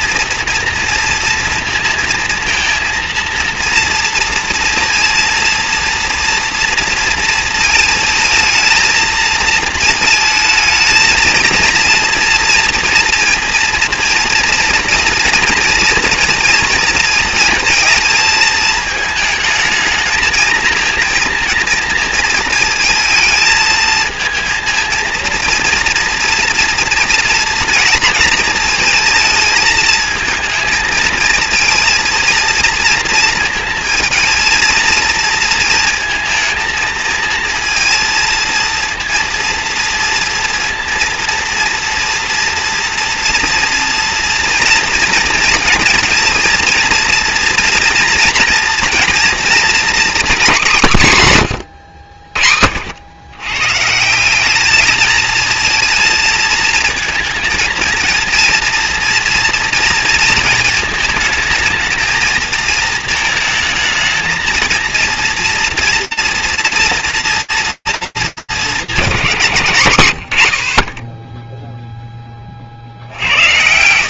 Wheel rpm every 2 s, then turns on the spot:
230, 230, 230, 230, 220, 220, 230, 230, 230, 220, 230, 220, 220, 230, 220, 220, 230, 230, 230, 230, 230, 230, 230, 230, 230, 150, 80, 210, 230, 230, 230, 230, 230, 230, 210, 90, 30.
none